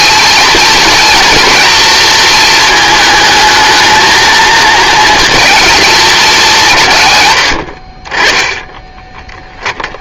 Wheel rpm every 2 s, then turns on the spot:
230, 220, 220, 150, 10.
8-10